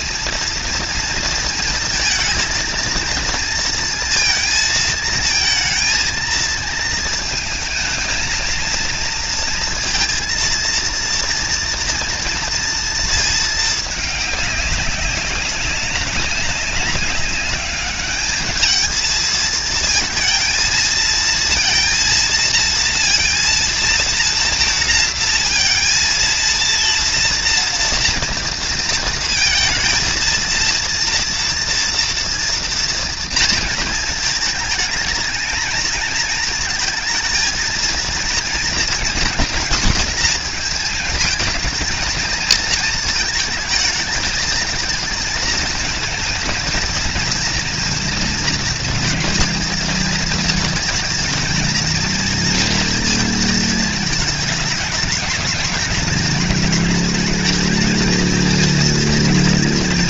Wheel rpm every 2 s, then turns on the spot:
230, 230, 220, 220, 230, 230, 230, 200, 200, 220, 230, 230, 230, 230, 230, 230, 230, 220, 230, 230, 220, 230, 220, 230, 230, 220, 230, 210, 220, 220.
none